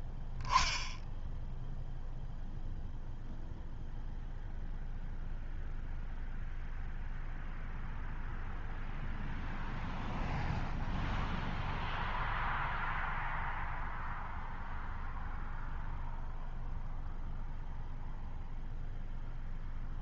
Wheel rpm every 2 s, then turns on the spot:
0, 0, 0, 0, 0, 0, 0, 0, 0, 0.
none